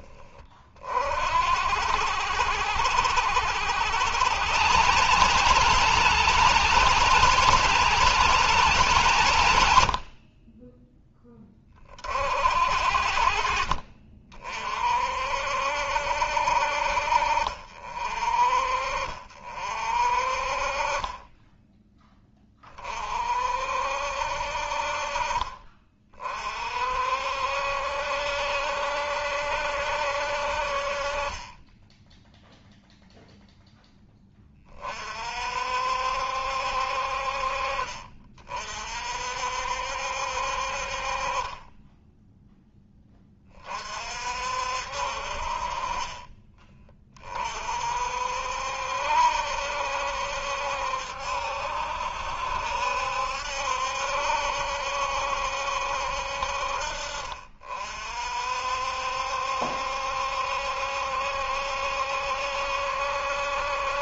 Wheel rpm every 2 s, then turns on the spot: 30, 60, 130, 170, 160, 40, 50, 40, 60, 40, 40, 20, 50, 40, 70, 50, 0, 20, 60, 40, 50, 10, 60, 30, 60, 70, 70, 70, 60, 60, 70, 70.
none